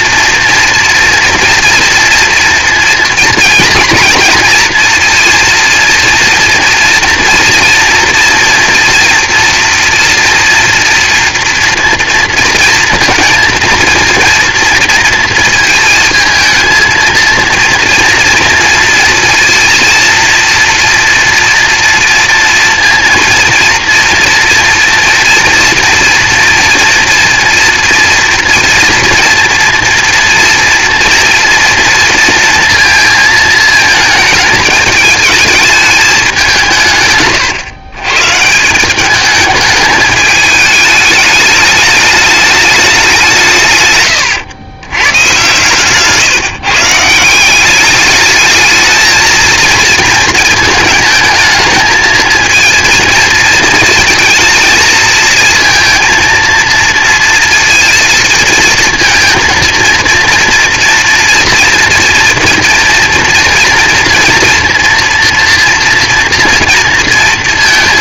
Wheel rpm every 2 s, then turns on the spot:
230, 230, 230, 240, 230, 240, 230, 230, 220, 230, 230, 230, 230, 230, 240, 230, 230, 210, 170, 170, 210, 210, 110, 150, 220, 220, 230, 230, 230, 230, 240, 230, 230, 230.
none